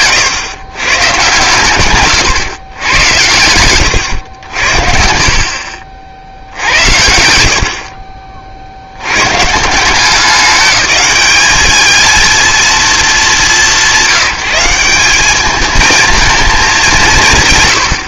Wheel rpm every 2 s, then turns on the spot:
120, 110, 70, 70, 60, 200, 230, 180, 210.
none